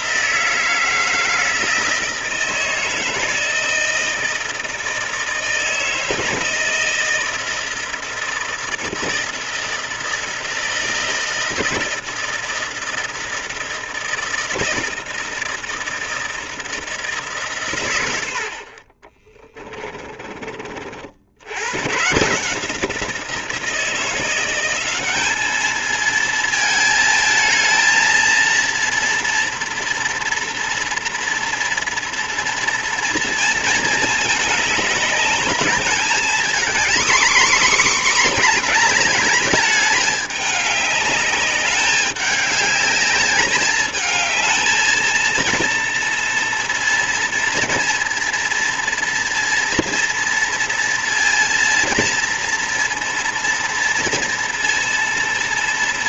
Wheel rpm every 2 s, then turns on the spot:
160, 160, 160, 160, 160, 160, 160, 160, 160, 60, 40, 170, 190, 220, 230, 230, 230, 210, 240, 230, 210, 200, 220, 230, 230, 230, 230, 230.
none